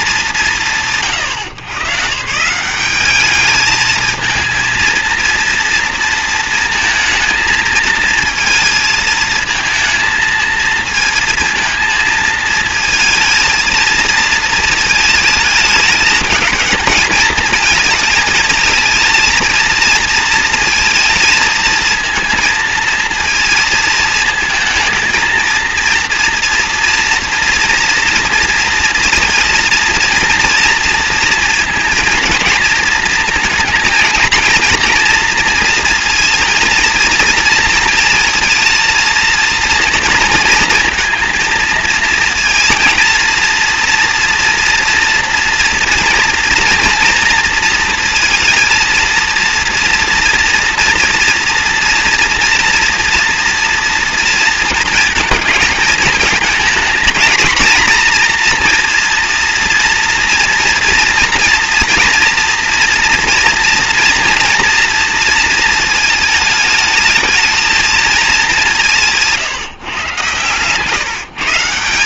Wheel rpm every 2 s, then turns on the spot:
150, 190, 230, 230, 220, 230, 220, 220, 210, 220, 220, 230, 230, 230, 230, 230, 230, 230, 230, 230, 230, 230, 230, 240, 230, 230, 240, 220, 230, 230, 240, 230, 230, 220, 160, 150.
68-70